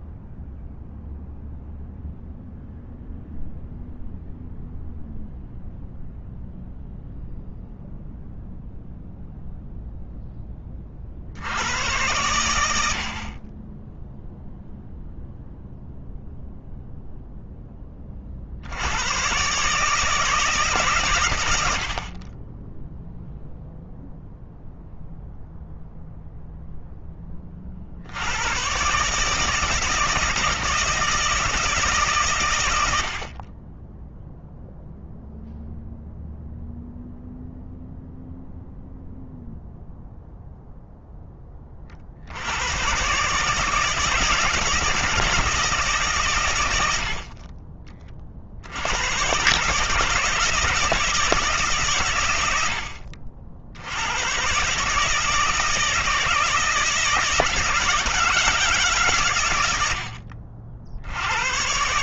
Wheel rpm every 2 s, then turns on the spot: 0, 0, 0, 0, 0, 40, 70, 0, 0, 100, 130, 0, 0, 10, 130, 160, 70, 0, 0, 0, 10, 130, 160, 80, 90, 160, 70, 150, 160, 140, 80.
none